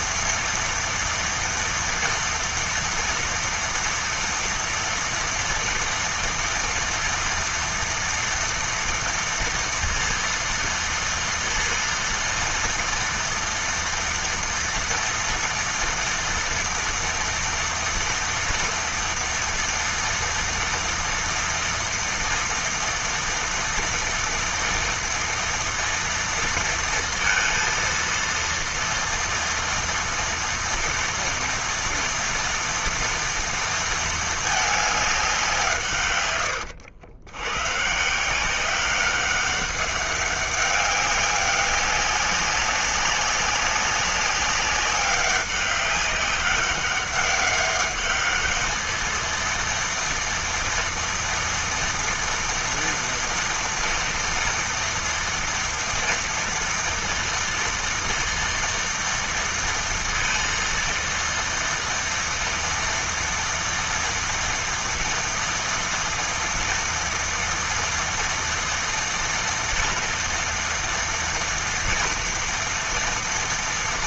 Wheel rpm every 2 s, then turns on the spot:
230, 230, 230, 230, 230, 230, 230, 230, 230, 230, 230, 230, 230, 230, 230, 240, 230, 210, 90, 190, 200, 200, 200, 190, 220, 230, 230, 230, 230, 230, 230, 230, 230, 230, 230, 230, 230.
none